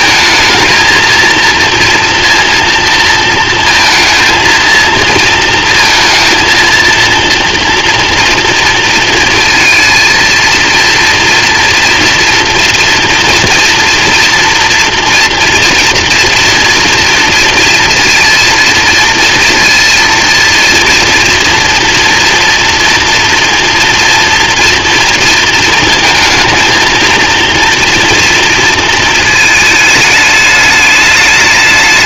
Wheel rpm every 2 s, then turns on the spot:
220, 230, 230, 230, 230, 230, 230, 230, 240, 230, 230, 230, 230, 220, 230, 210.
none